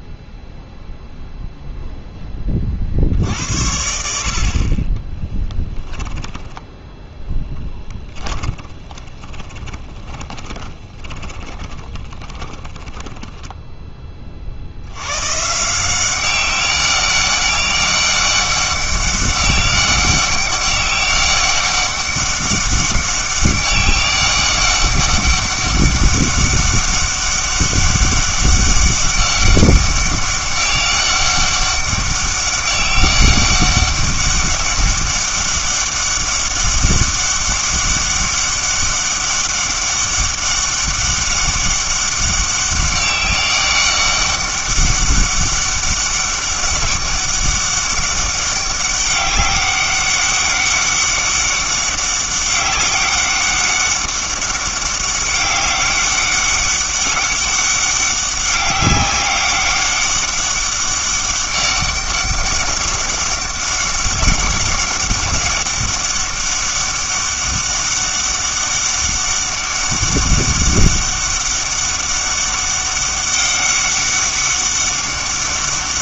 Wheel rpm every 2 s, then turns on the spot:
0, 40, 30, 10, 20, 30, 10, 80, 200, 200, 200, 200, 200, 200, 200, 200, 200, 200, 200, 200, 200, 200, 200, 200, 200, 200, 200, 200, 200, 190, 200, 200, 190, 200, 200, 200, 200, 200.
8-14